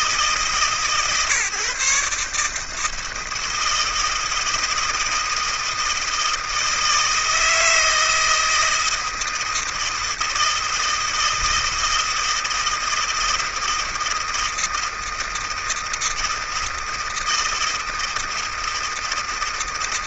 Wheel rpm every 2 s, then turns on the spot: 150, 150, 160, 160, 160, 160, 160, 160, 160, 160.
none